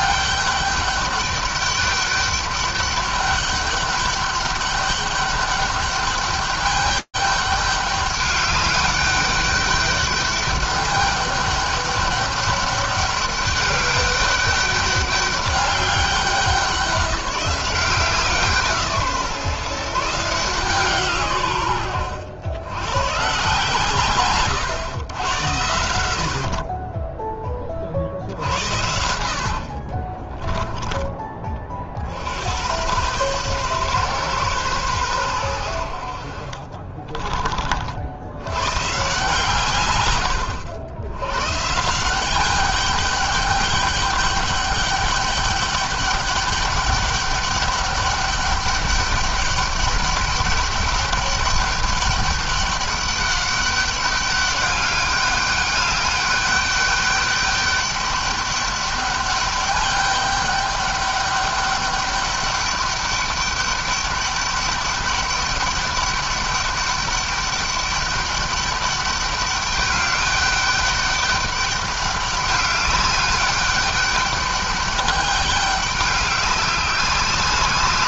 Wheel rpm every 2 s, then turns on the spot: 200, 200, 200, 200, 200, 200, 200, 200, 190, 160, 140, 120, 120, 20, 80, 20, 120, 120, 30, 140, 100, 200, 200, 200, 200, 200, 200, 200, 200, 200, 200, 200, 200, 200, 200, 200, 200, 200, 190.
36-38